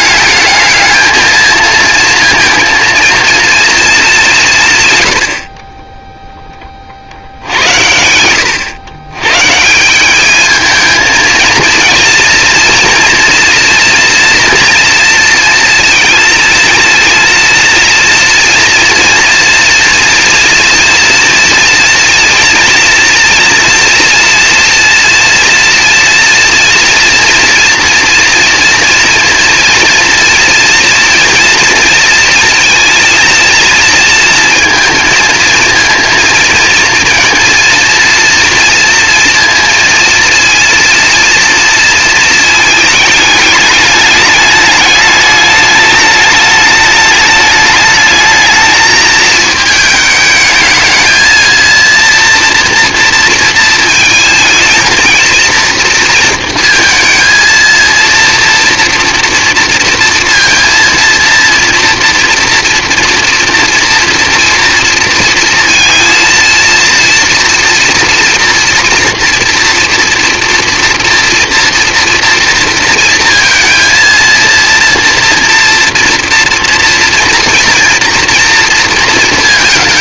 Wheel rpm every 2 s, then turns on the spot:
220, 230, 150, 40, 120, 220, 230, 230, 230, 230, 230, 240, 230, 230, 230, 230, 230, 230, 230, 230, 230, 220, 210, 210, 220, 220, 230, 220, 230, 230, 230, 230, 230, 230, 230, 230, 230, 230, 230, 230.
none